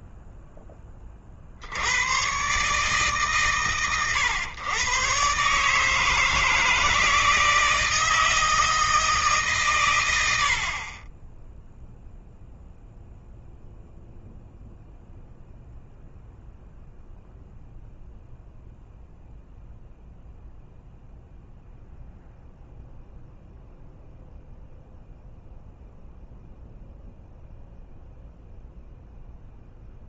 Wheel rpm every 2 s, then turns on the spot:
30, 150, 120, 160, 160, 30, 0, 0, 0, 0, 0, 0, 0, 0, 0.
none